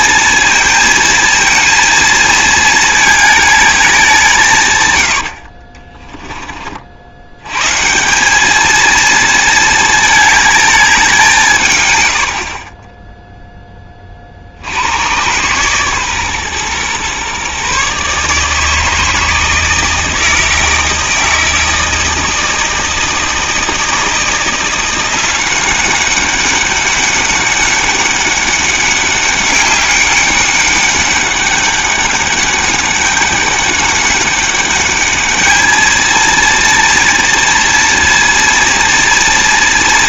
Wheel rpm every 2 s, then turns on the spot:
230, 220, 130, 30, 220, 210, 30, 60, 130, 160, 160, 160, 170, 200, 200, 200, 200, 200, 230, 240.
12-14